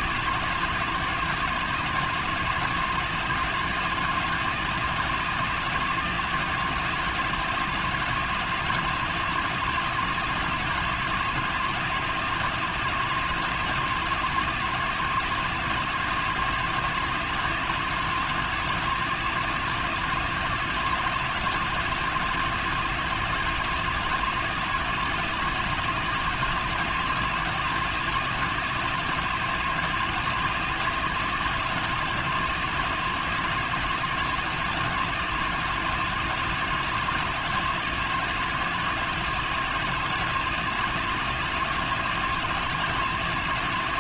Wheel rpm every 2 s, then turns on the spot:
160, 170, 170, 160, 160, 160, 160, 160, 170, 160, 170, 160, 170, 160, 160, 160, 160, 160, 160, 160, 160, 160.
none